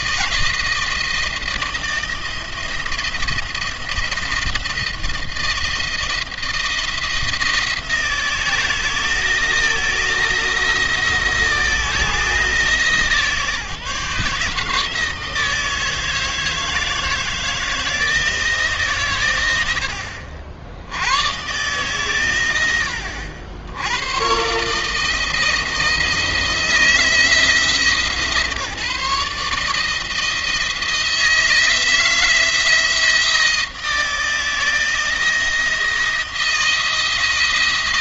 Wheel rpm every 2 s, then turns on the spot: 160, 170, 170, 170, 160, 170, 150, 150, 160, 150, 70, 90, 150, 160, 160, 160, 170, 160, 160.
none